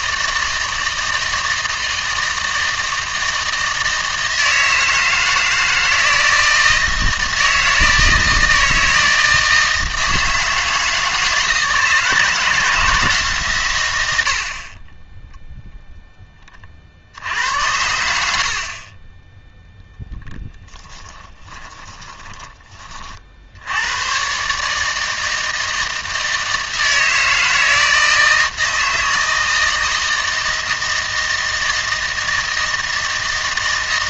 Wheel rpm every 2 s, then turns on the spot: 160, 160, 160, 160, 160, 160, 160, 50, 40, 40, 10, 30, 140, 160, 160, 160, 160.
18-22